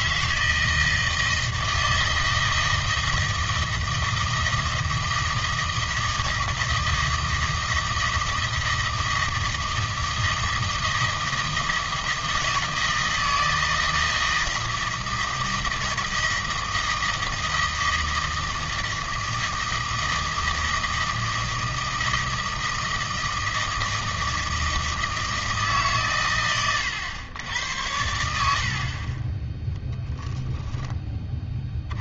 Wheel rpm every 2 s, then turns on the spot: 160, 160, 160, 160, 160, 160, 160, 160, 160, 160, 160, 160, 160, 100, 60, 10.
28-30